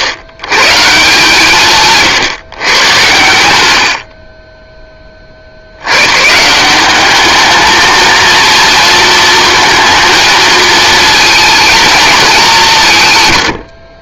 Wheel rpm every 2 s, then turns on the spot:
130, 140, 20, 170, 230, 230, 170.
none